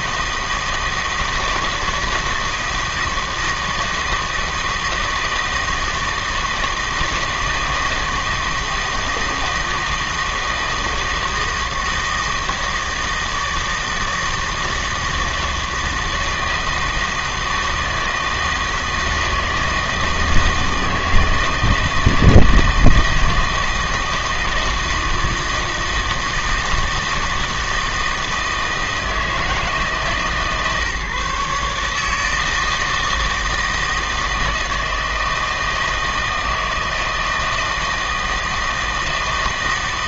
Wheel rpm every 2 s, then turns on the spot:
160, 160, 160, 160, 160, 160, 160, 160, 160, 160, 160, 160, 160, 160, 160, 150, 160, 160, 160, 160.
none